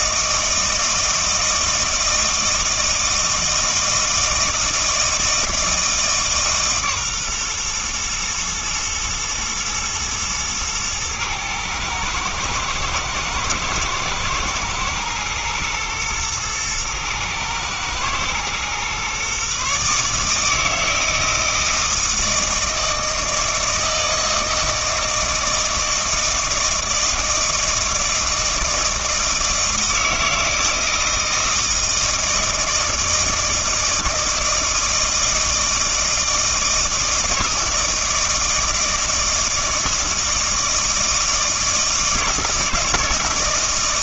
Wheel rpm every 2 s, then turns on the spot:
160, 160, 160, 140, 110, 110, 110, 110, 110, 120, 160, 160, 160, 160, 160, 160, 160, 160, 160, 160, 160, 160.
none